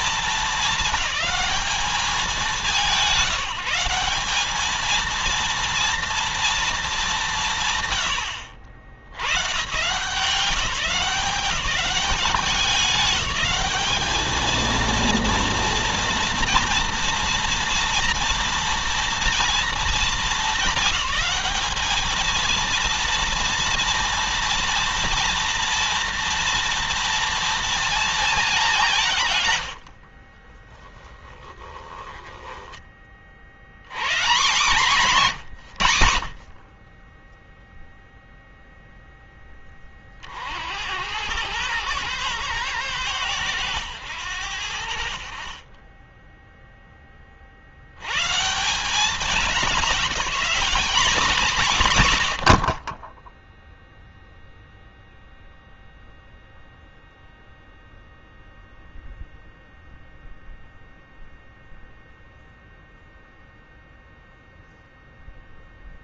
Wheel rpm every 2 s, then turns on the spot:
220, 190, 210, 220, 80, 160, 200, 220, 230, 230, 210, 230, 240, 240, 210, 30, 10, 180, 60, 0, 60, 110, 80, 10, 170, 220, 70, 0, 0, 0, 0, 0, 0.
30-32